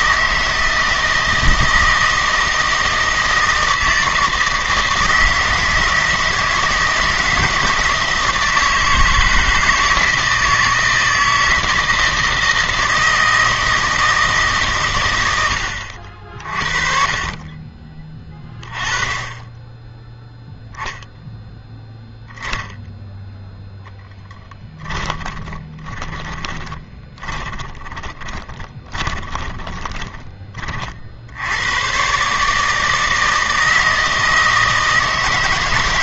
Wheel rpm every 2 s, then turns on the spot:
160, 160, 160, 160, 160, 160, 160, 140, 30, 20, 0, 0, 10, 20, 20, 40, 160, 160.
24-30